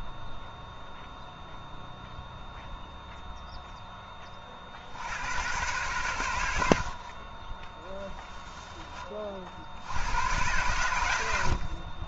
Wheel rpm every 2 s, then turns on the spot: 0, 0, 60, 60, 10, 100.
none